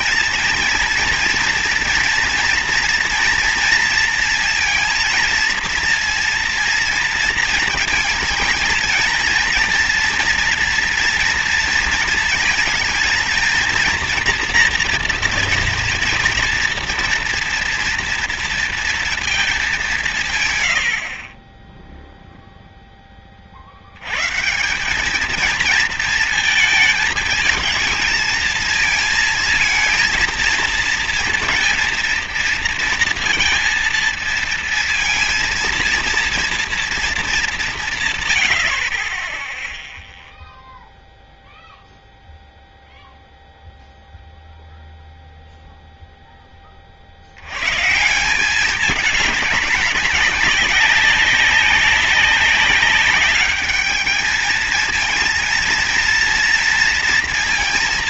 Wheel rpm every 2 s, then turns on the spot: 230, 230, 230, 230, 220, 230, 230, 240, 230, 230, 100, 0, 180, 220, 220, 230, 230, 230, 230, 70, 0, 0, 0, 30, 200, 200, 190, 220, 230.
none